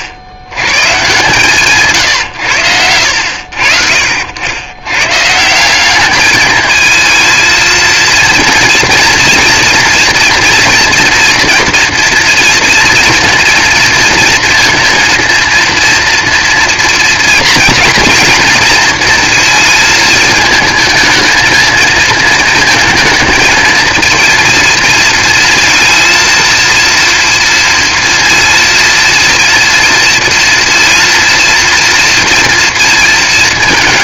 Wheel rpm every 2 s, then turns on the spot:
60, 80, 100, 220, 230, 230, 230, 230, 230, 230, 220, 220, 230, 230, 230, 230, 230.
none